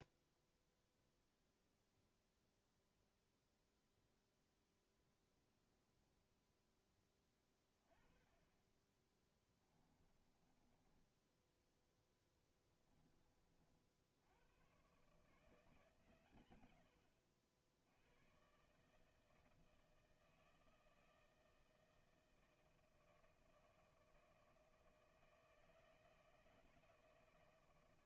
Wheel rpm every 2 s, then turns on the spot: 0, 0, 0, 10, 20, 20, 10, 100, 120, 130, 160, 160, 160, 160.
10-14